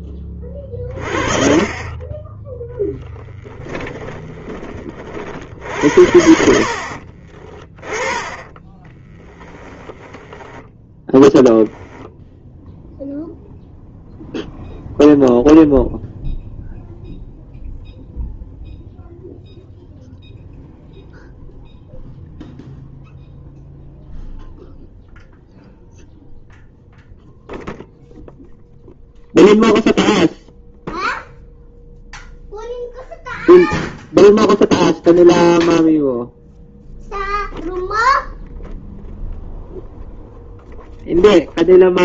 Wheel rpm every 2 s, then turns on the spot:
10, 20, 60, 20, 20, 0, 0, 0, 0, 0, 0, 0, 0, 0, 0, 0, 0, 0, 0, 0, 0.
2-4 8-10